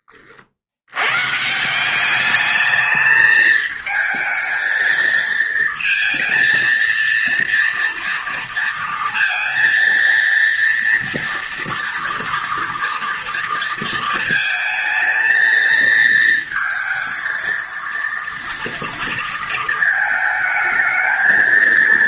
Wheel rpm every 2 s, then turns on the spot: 100, 220, 230, 230, 230, 230, 230, 220, 230, 230, 220.
none